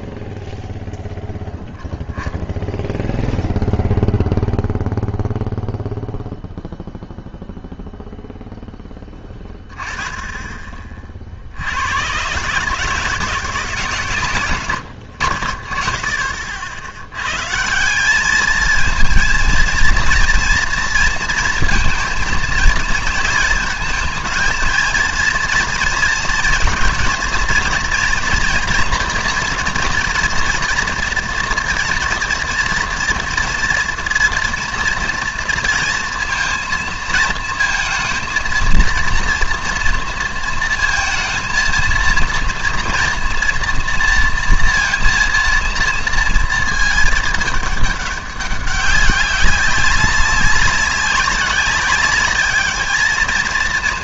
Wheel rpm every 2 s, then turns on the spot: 0, 0, 0, 0, 0, 20, 140, 110, 60, 220, 230, 230, 220, 220, 240, 230, 230, 230, 230, 230, 230, 230, 230, 220, 200, 190, 210.
none